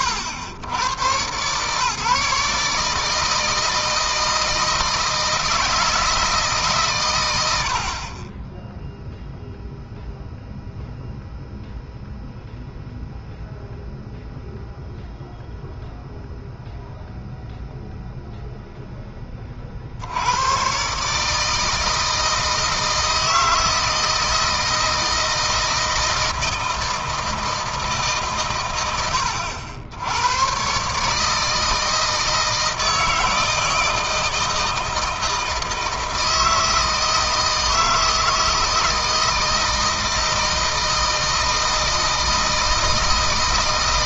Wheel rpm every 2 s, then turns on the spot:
110, 160, 160, 130, 0, 0, 0, 0, 0, 10, 130, 160, 160, 160, 100, 140, 160, 160, 160, 160, 160, 160.
none